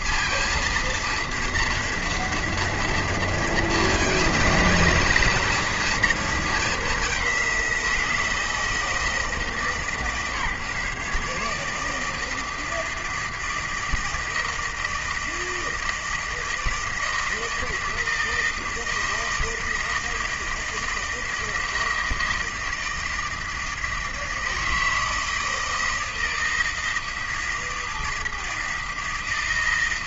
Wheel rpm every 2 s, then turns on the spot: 230, 230, 230, 220, 160, 150, 160, 160, 160, 160, 160, 160, 160, 160, 160.
none